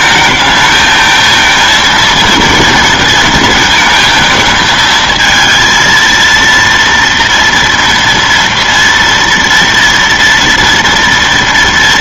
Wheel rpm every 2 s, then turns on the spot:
220, 230, 220, 230, 230, 230.
none